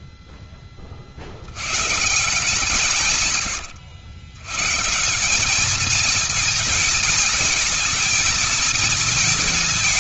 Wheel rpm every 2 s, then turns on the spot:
10, 150, 140, 220, 220.
none